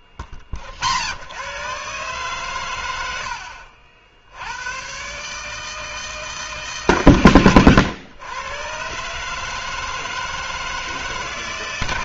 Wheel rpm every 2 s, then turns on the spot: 30, 140, 80, 150, 110, 160.
none